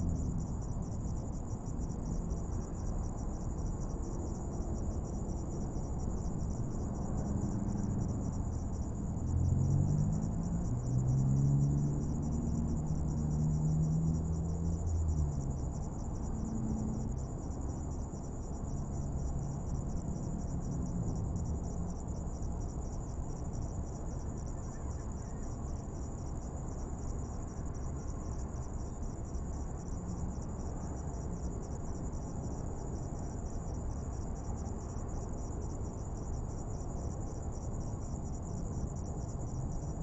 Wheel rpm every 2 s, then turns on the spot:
0, 0, 0, 0, 0, 0, 0, 0, 0, 0, 0, 0, 0, 0, 0, 0, 0, 0, 0, 0.
none